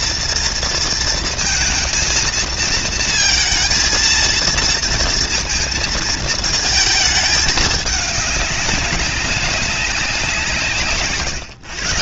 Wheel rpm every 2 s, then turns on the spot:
230, 230, 230, 220, 210, 190.
none